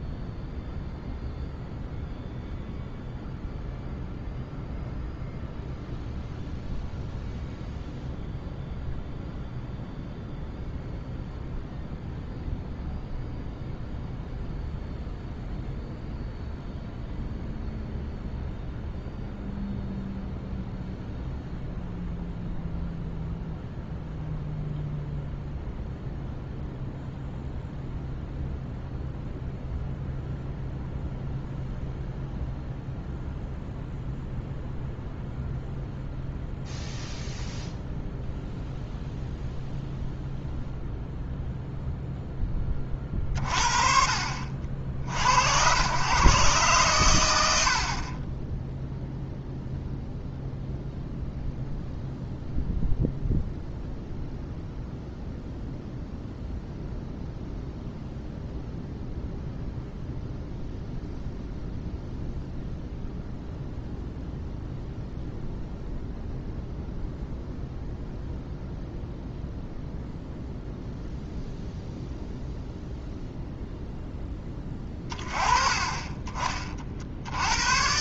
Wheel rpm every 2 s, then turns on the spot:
0, 0, 0, 0, 0, 0, 0, 0, 0, 0, 0, 0, 0, 0, 0, 0, 0, 0, 0, 0, 0, 20, 50, 120, 0, 0, 0, 0, 0, 0, 0, 0, 0, 0, 0, 0, 0, 20, 40.
none